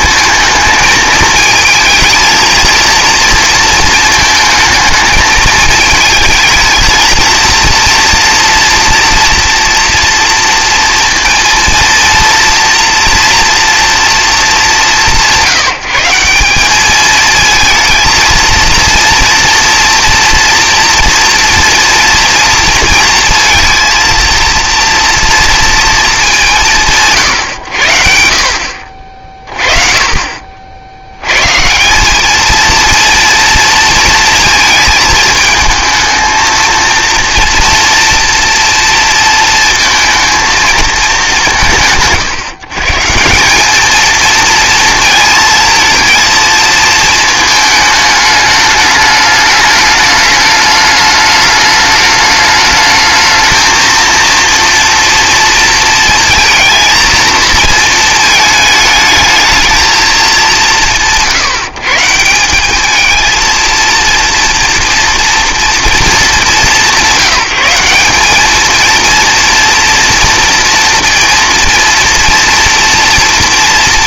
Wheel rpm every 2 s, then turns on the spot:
220, 230, 220, 220, 240, 230, 230, 200, 200, 230, 230, 230, 230, 120, 50, 60, 230, 220, 230, 230, 230, 140, 230, 220, 210, 210, 210, 230, 230, 220, 140, 200, 230, 180, 230, 230, 230.
none